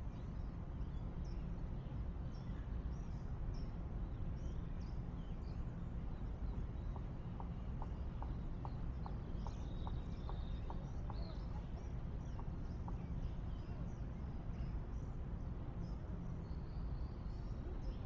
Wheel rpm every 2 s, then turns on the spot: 0, 0, 0, 0, 0, 0, 0, 0, 0.
none